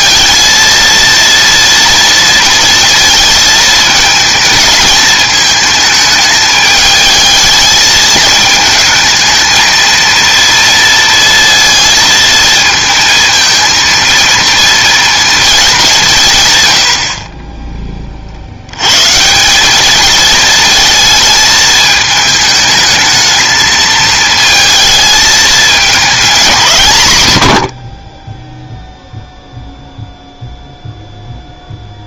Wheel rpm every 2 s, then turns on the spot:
230, 230, 220, 210, 220, 230, 220, 230, 130, 80, 220, 220, 220, 180, 0, 0.
none